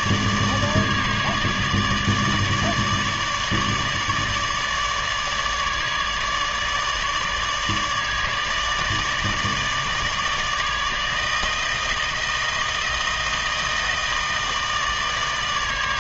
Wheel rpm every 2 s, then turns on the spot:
150, 150, 150, 150, 150, 160, 160, 160.
none